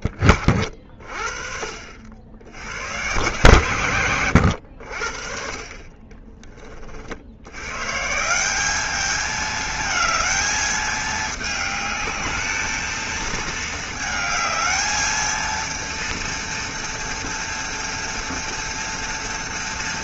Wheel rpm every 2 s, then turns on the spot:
60, 110, 80, 30, 200, 220, 220, 220, 240, 230.
none